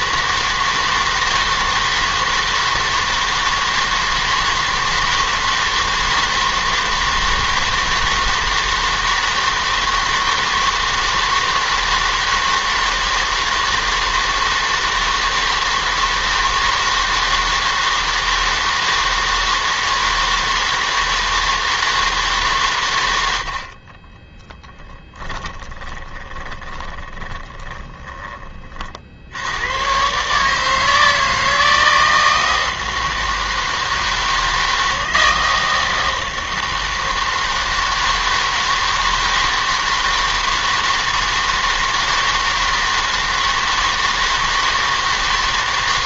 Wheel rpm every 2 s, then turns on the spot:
160, 160, 160, 160, 160, 160, 160, 160, 160, 160, 160, 130, 20, 20, 30, 160, 160, 160, 160, 160, 160, 160, 160.
24-28